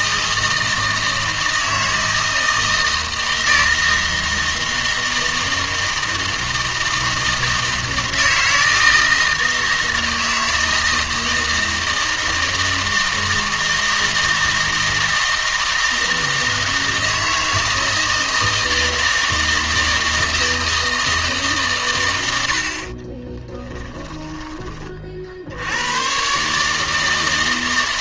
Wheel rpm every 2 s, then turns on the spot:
160, 160, 160, 160, 160, 160, 160, 160, 160, 160, 160, 60, 20, 150.
none